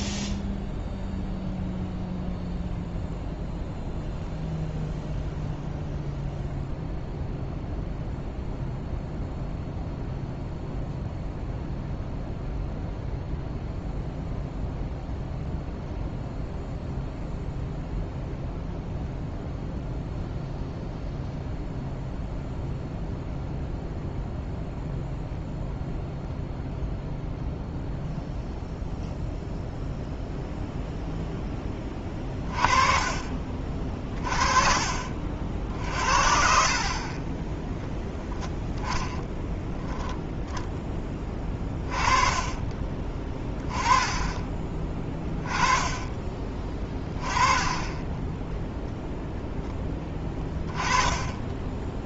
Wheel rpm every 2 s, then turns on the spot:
0, 0, 0, 0, 0, 0, 0, 0, 0, 0, 0, 0, 0, 0, 0, 0, 30, 50, 40, 0, 10, 20, 20, 20, 0, 20.
32-34 42-44